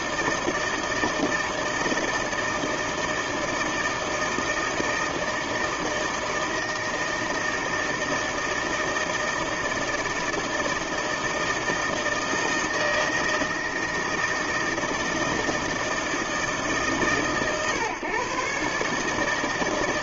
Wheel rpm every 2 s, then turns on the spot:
160, 160, 160, 160, 160, 160, 160, 160, 140, 140.
none